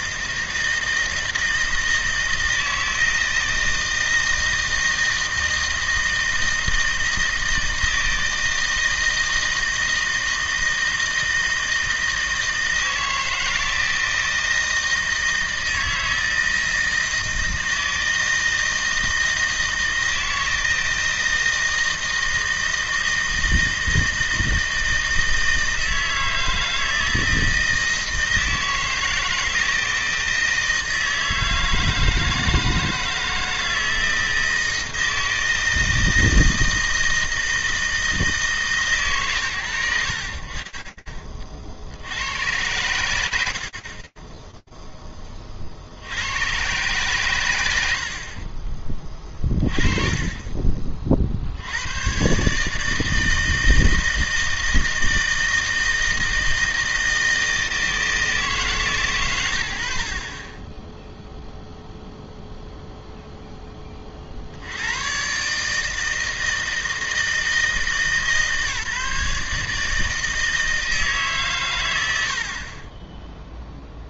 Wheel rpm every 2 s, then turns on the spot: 160, 160, 160, 160, 160, 160, 160, 160, 160, 160, 160, 160, 160, 160, 160, 160, 160, 160, 160, 160, 60, 100, 10, 120, 30, 60, 160, 160, 160, 100, 0, 10, 150, 160, 150, 130, 0.
none